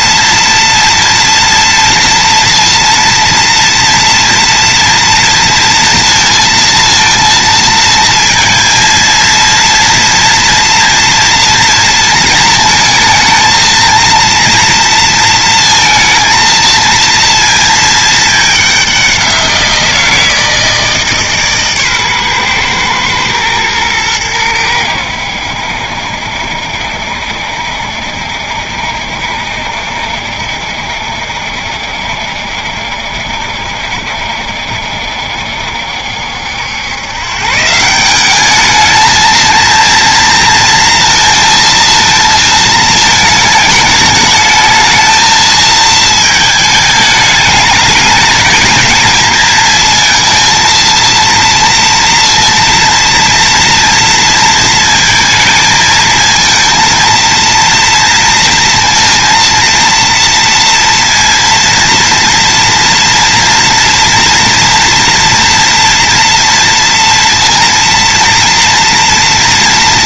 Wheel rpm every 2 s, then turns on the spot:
240, 230, 230, 230, 230, 230, 220, 230, 230, 190, 160, 120, 90, 70, 70, 70, 70, 70, 110, 220, 230, 220, 220, 210, 220, 230, 230, 230, 230, 230, 230, 230, 230, 230, 230.
none